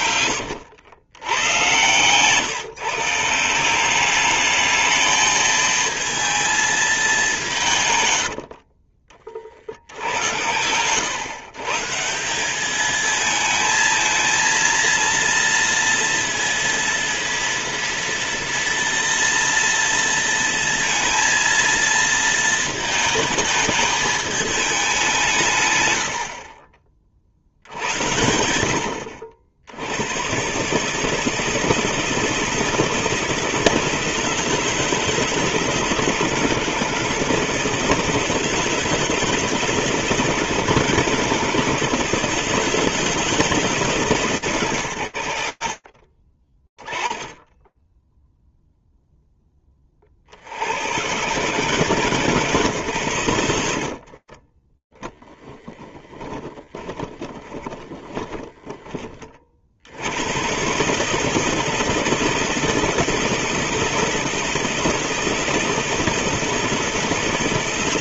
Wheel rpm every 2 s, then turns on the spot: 90, 140, 220, 220, 40, 110, 200, 230, 230, 230, 230, 230, 210, 50, 70, 140, 160, 160, 160, 160, 160, 160, 150, 20, 0, 80, 140, 20, 20, 30, 150, 170, 170, 160.
8-10 54-58